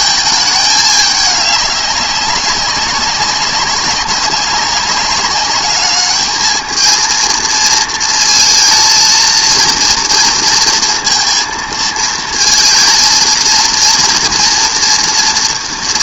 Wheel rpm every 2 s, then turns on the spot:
210, 190, 200, 220, 230, 230, 230, 230.
none